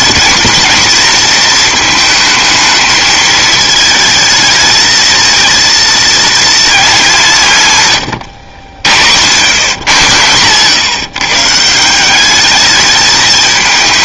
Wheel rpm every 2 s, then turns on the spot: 230, 220, 220, 230, 70, 130, 210.
none